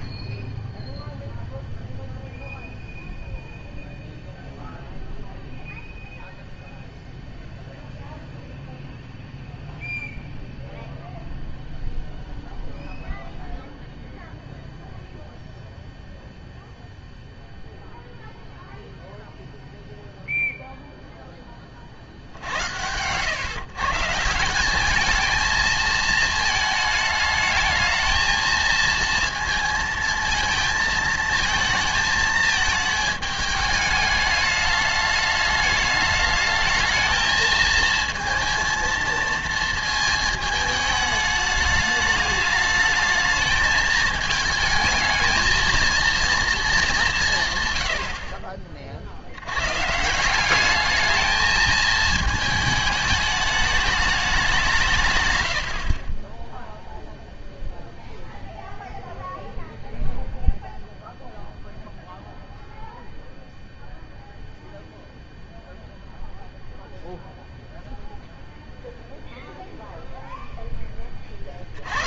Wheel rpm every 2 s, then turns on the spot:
0, 0, 0, 0, 0, 0, 0, 0, 0, 0, 0, 80, 180, 220, 220, 220, 220, 210, 220, 230, 220, 210, 220, 220, 50, 200, 220, 190, 10, 0, 0, 0, 0, 0, 0, 0.
none